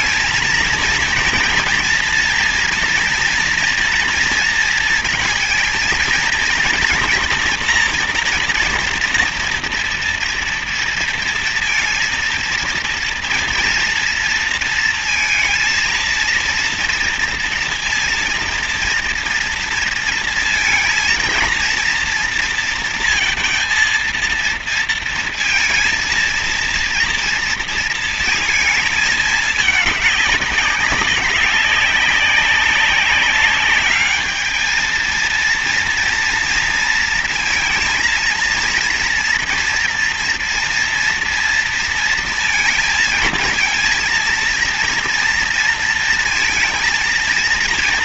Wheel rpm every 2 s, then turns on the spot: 230, 230, 230, 240, 230, 230, 230, 230, 230, 230, 230, 230, 230, 230, 220, 200, 190, 220, 230, 230, 230, 220, 230, 230.
none